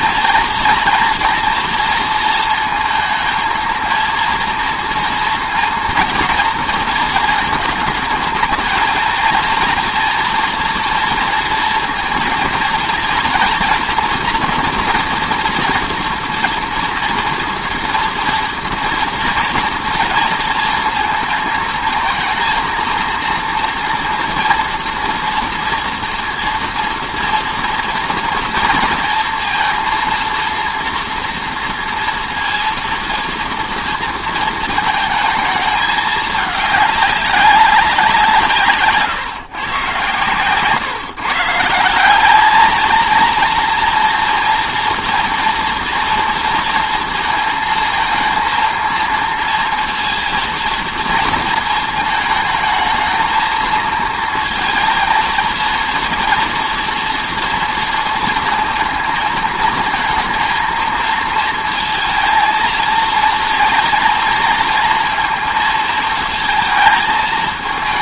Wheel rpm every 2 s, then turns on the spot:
230, 220, 230, 220, 220, 240, 230, 230, 230, 240, 230, 230, 230, 230, 230, 230, 230, 220, 210, 170, 130, 220, 240, 230, 220, 230, 220, 230, 230, 230, 230, 220, 230, 220.
none